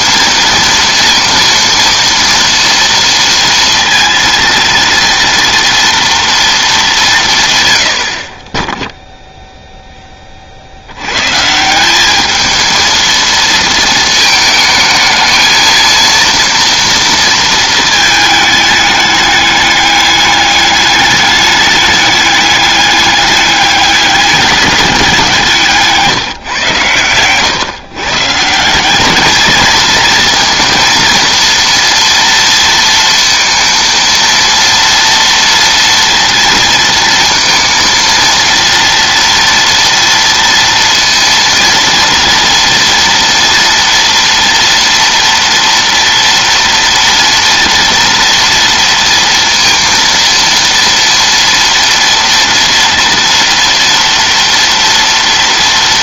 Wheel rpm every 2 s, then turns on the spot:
230, 230, 230, 210, 10, 50, 220, 220, 230, 220, 200, 200, 200, 130, 160, 230, 230, 230, 230, 230, 230, 230, 230, 230, 230, 230, 230, 230.
none